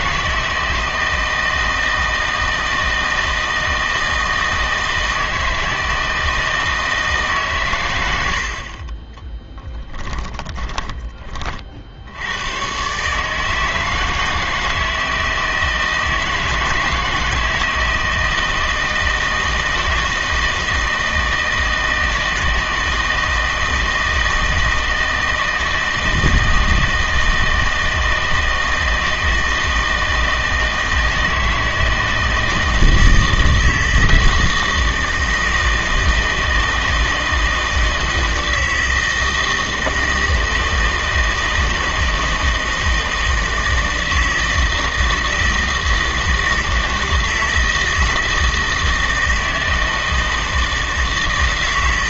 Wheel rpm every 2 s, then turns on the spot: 160, 160, 160, 160, 50, 20, 120, 160, 160, 160, 160, 160, 160, 160, 160, 160, 160, 160, 160, 160, 160, 160, 160, 160, 160, 160.
10-12